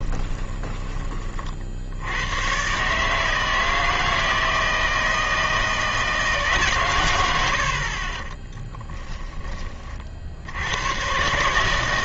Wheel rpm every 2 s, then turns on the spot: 20, 120, 160, 140, 10, 90.
0-2 8-10